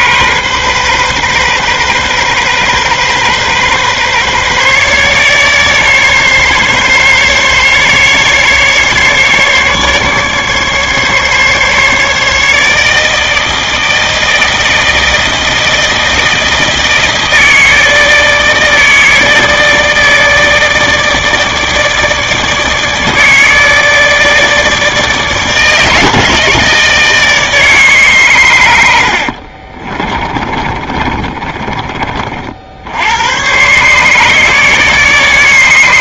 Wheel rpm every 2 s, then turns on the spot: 130, 130, 140, 140, 140, 150, 150, 160, 160, 160, 160, 160, 160, 160, 100, 30, 60, 150.
30-32